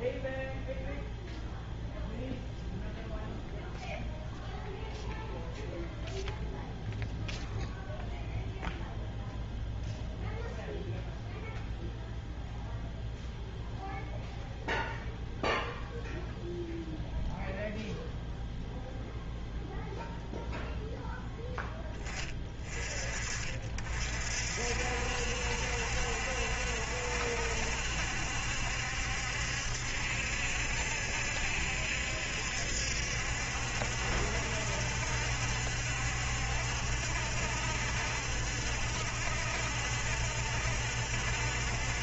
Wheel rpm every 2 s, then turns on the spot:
0, 0, 0, 0, 0, 0, 0, 0, 0, 0, 0, 30, 60, 70, 70, 70, 70, 60, 70, 70, 70.
none